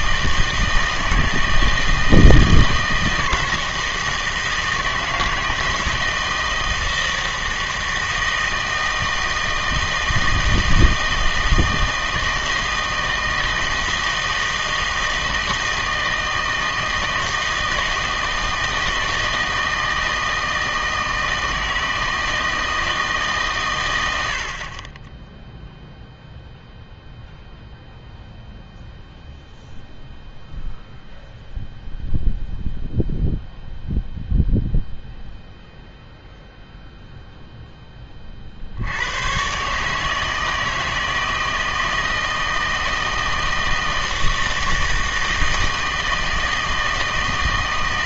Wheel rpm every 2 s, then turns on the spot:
160, 160, 160, 160, 160, 160, 160, 160, 160, 160, 160, 160, 50, 0, 0, 0, 0, 0, 0, 60, 160, 160, 160, 160.
none